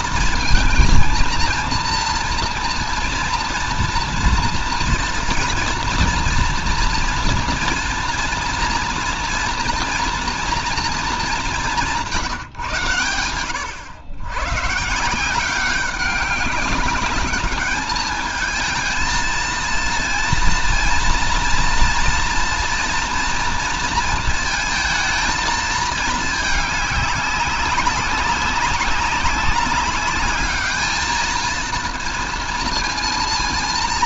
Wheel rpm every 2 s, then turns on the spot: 230, 240, 230, 230, 240, 230, 140, 150, 200, 220, 230, 230, 230, 210, 190, 210, 230.
none